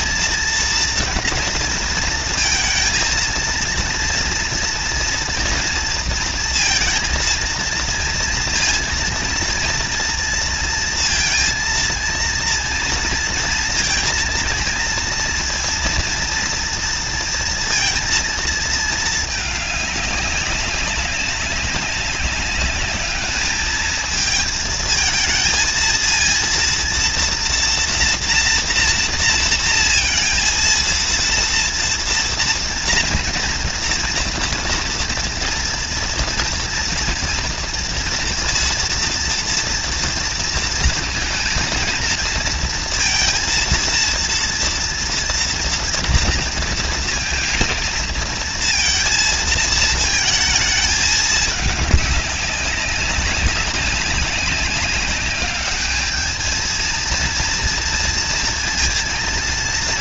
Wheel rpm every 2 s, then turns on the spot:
230, 230, 230, 230, 230, 230, 230, 230, 230, 230, 200, 200, 220, 230, 240, 230, 230, 230, 240, 230, 230, 230, 230, 230, 230, 220, 200, 200, 220, 230.
none